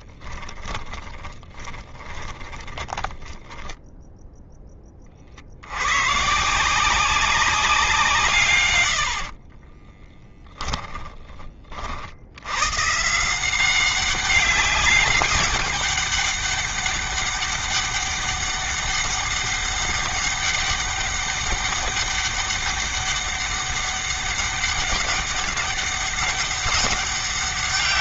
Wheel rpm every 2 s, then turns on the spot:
20, 20, 10, 150, 150, 20, 90, 190, 200, 200, 200, 200, 200, 200.
0-4 10-12